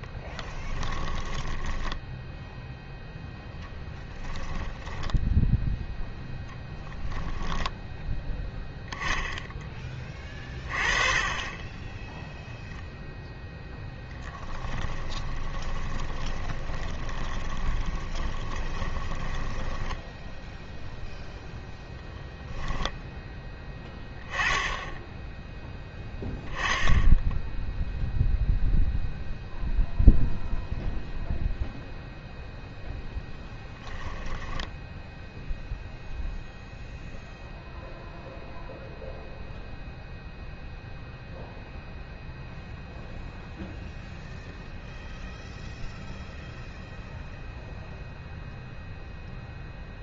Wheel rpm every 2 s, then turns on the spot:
10, 0, 10, 0, 10, 30, 0, 10, 20, 20, 0, 10, 10, 10, 0, 0, 0, 10, 0, 0, 0, 0, 0, 0, 0.
0-2 4-6 14-20 22-24